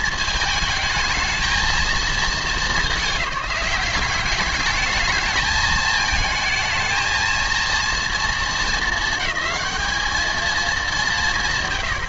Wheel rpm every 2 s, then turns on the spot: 220, 210, 220, 220, 220, 210.
none